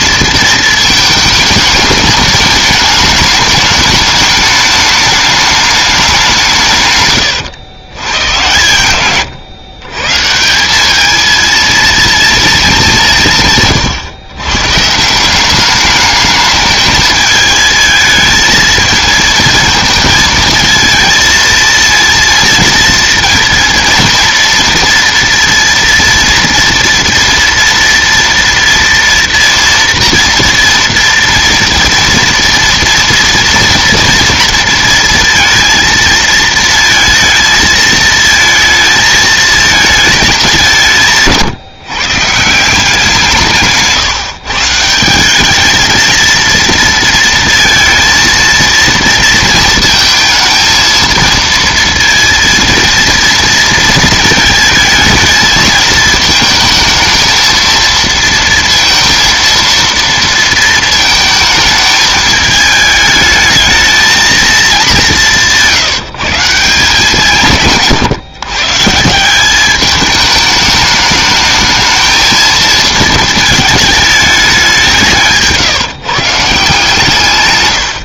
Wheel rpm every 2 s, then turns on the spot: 230, 210, 210, 170, 120, 170, 220, 130, 210, 220, 220, 230, 230, 230, 230, 230, 230, 230, 230, 220, 200, 160, 160, 230, 230, 230, 230, 220, 220, 230, 230, 210, 220, 160, 140, 210, 220, 190, 150.
none